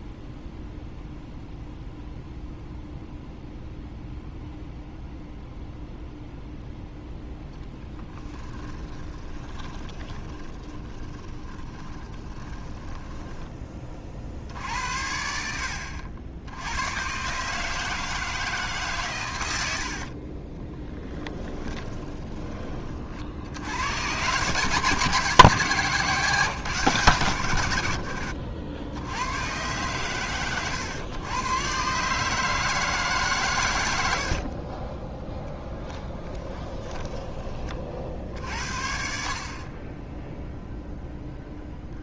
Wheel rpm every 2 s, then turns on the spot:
0, 0, 0, 0, 20, 20, 20, 70, 90, 140, 20, 30, 150, 140, 90, 110, 150, 30, 10, 50, 0.
8-14 20-22 36-38